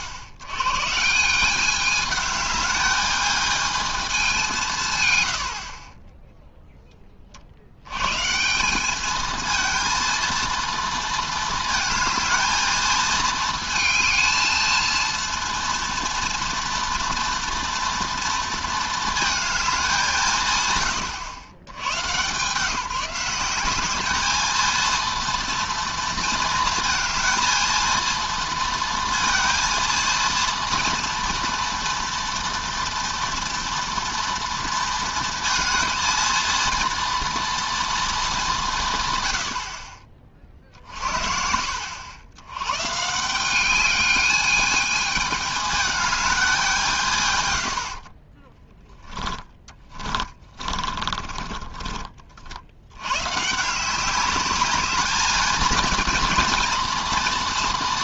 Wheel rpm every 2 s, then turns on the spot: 110, 210, 170, 0, 170, 230, 230, 220, 230, 230, 130, 160, 220, 230, 230, 230, 230, 230, 230, 190, 50, 110, 210, 190, 20, 30, 70, 200, 240.
50-52